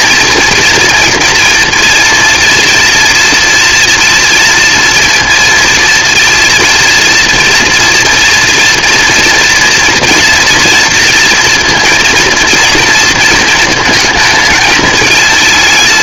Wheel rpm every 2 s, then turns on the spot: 230, 240, 230, 230, 240, 230, 230, 220.
none